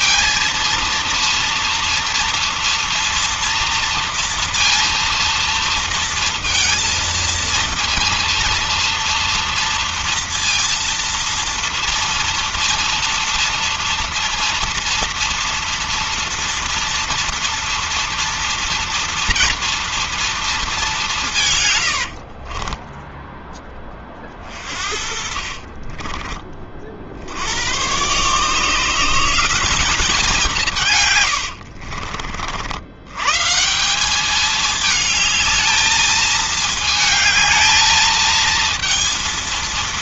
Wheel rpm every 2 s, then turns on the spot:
230, 230, 230, 230, 230, 230, 230, 230, 230, 230, 220, 40, 30, 40, 150, 160, 60, 210, 220, 220.
22-26